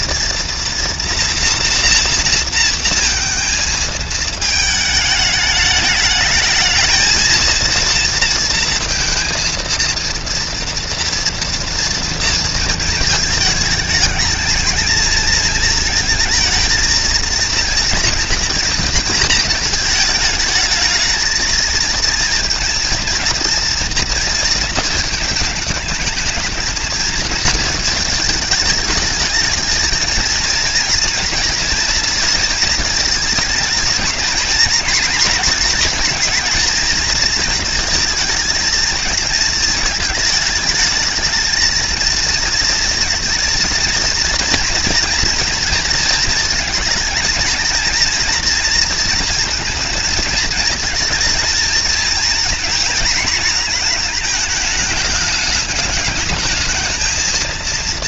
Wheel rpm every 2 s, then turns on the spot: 230, 230, 220, 220, 230, 230, 220, 220, 230, 230, 220, 230, 220, 230, 220, 240, 220, 230, 230, 220, 220, 230, 230, 230, 230, 230, 230, 210, 230.
none